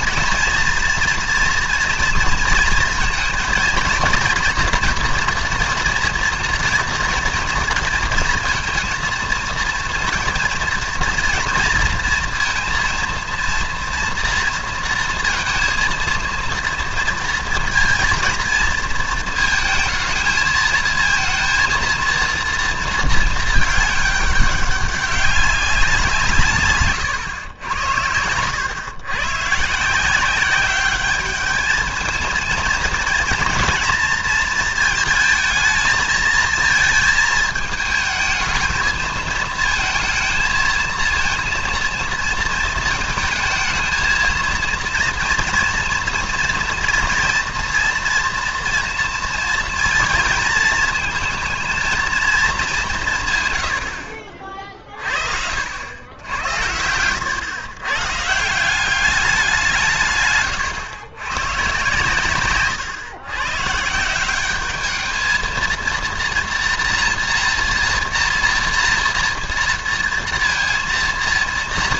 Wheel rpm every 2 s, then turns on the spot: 230, 230, 240, 230, 230, 230, 230, 230, 230, 230, 220, 230, 200, 150, 100, 190, 230, 220, 220, 220, 220, 230, 230, 240, 230, 230, 200, 40, 90, 170, 120, 130, 200, 230, 230, 230.
56-58